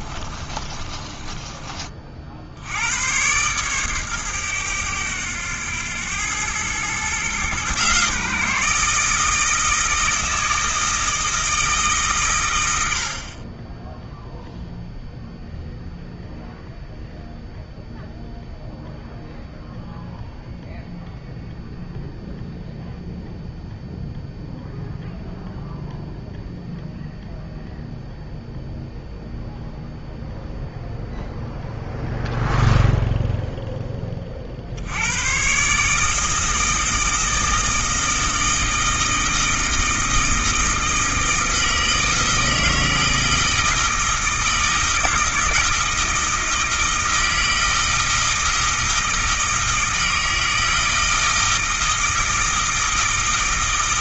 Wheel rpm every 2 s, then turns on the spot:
30, 90, 100, 120, 160, 160, 80, 0, 0, 0, 0, 0, 0, 0, 0, 0, 0, 70, 160, 160, 160, 160, 160, 160, 160, 160, 160.
0-2